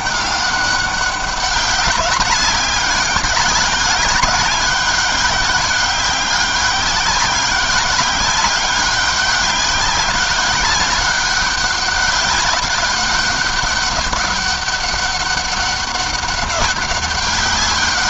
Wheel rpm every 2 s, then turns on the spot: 200, 200, 200, 190, 190, 200, 200, 200, 200.
none